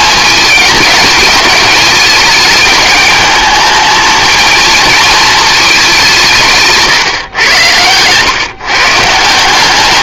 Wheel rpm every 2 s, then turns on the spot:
210, 210, 230, 150, 140.
none